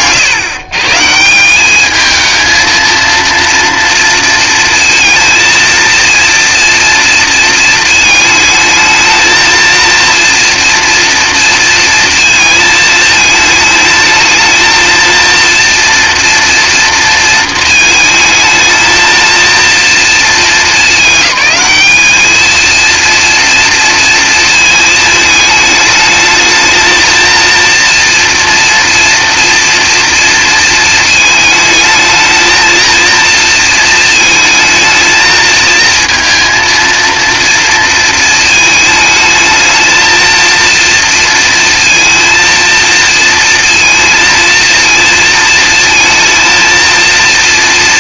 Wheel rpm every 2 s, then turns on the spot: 150, 230, 230, 230, 220, 230, 220, 230, 230, 220, 210, 230, 220, 220, 230, 230, 230, 220, 230, 220, 230, 230, 230, 230.
none